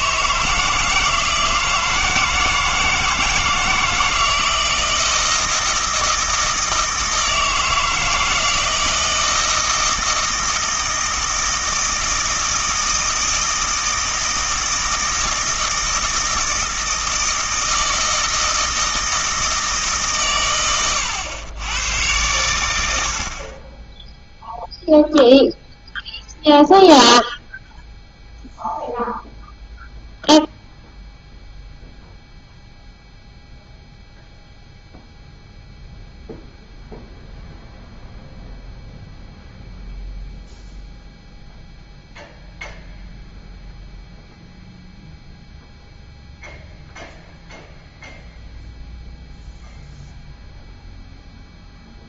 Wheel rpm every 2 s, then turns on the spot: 160, 160, 160, 160, 160, 160, 160, 160, 160, 160, 120, 100, 0, 0, 0, 0, 0, 0, 0, 0, 0, 0, 0, 0, 0, 0.
none